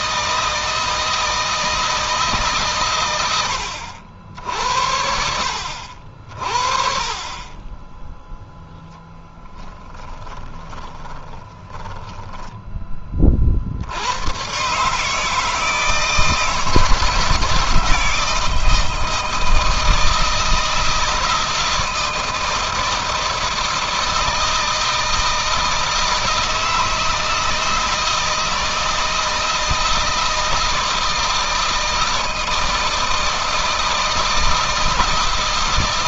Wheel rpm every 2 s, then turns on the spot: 160, 130, 70, 40, 0, 20, 20, 140, 160, 160, 160, 160, 160, 160, 160, 160, 160, 160.
10-12